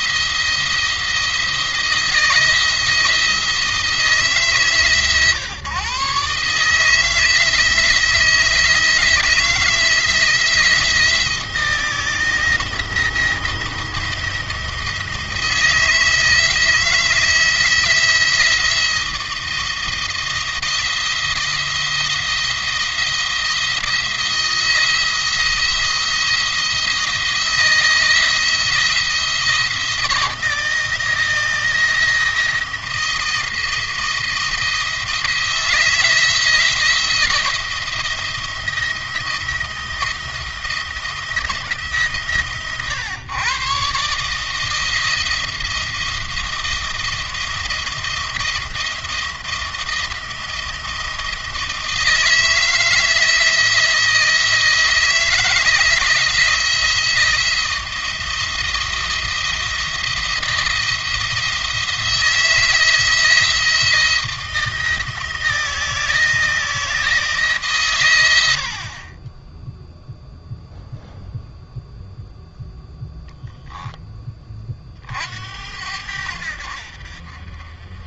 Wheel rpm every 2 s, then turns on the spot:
170, 170, 140, 150, 160, 170, 170, 170, 160, 170, 170, 170, 170, 170, 160, 170, 170, 160, 170, 170, 170, 120, 160, 170, 170, 170, 160, 160, 170, 170, 170, 160, 160, 160, 40, 0, 0, 40, 70.
none